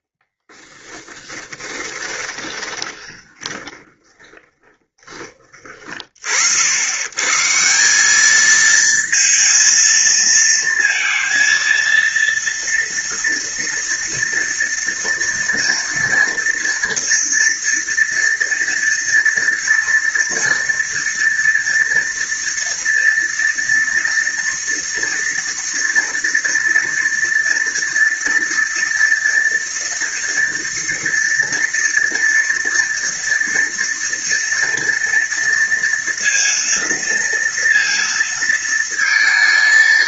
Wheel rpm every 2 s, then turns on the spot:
20, 20, 20, 70, 220, 230, 230, 230, 230, 230, 240, 230, 230, 230, 230, 230, 240, 230, 230, 230.
0-6